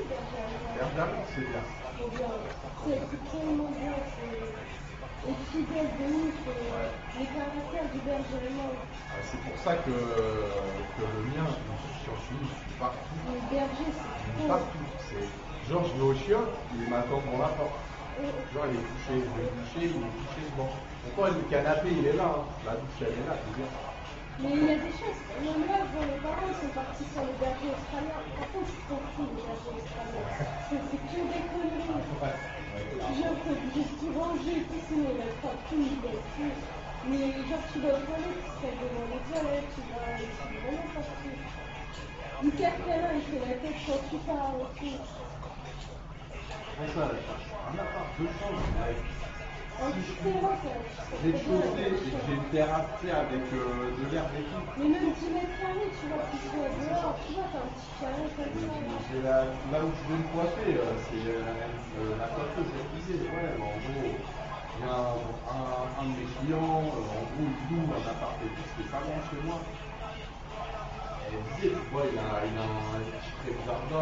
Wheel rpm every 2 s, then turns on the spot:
0, 0, 0, 0, 0, 0, 0, 0, 0, 0, 0, 0, 0, 0, 0, 0, 0, 0, 0, 0, 0, 0, 0, 0, 0, 0, 0, 0, 0, 0, 0, 0, 0, 0, 0, 0, 0.
none